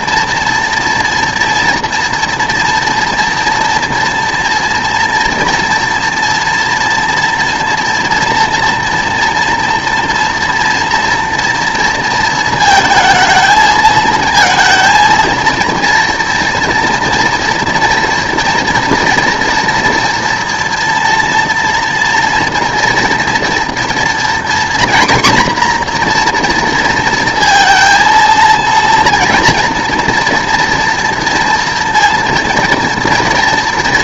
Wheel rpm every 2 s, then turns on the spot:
230, 230, 230, 230, 240, 230, 220, 220, 230, 240, 230, 230, 240, 230, 230, 230, 230.
none